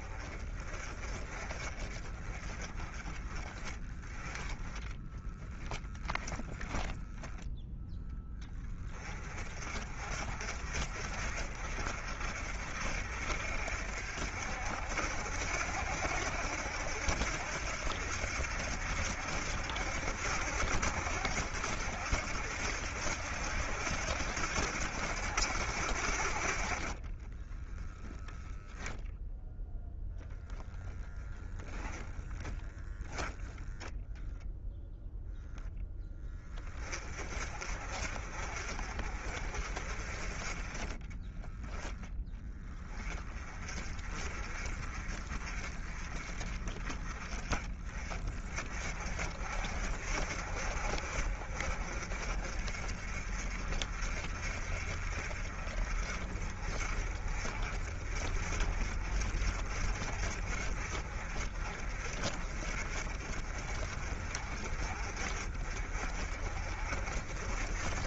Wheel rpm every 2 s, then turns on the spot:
30, 30, 20, 10, 20, 40, 50, 60, 70, 70, 70, 70, 70, 30, 0, 10, 20, 10, 30, 40, 20, 20, 40, 30, 40, 50, 50, 50, 40, 50, 40, 50, 50, 40.
4-6 30-32 40-42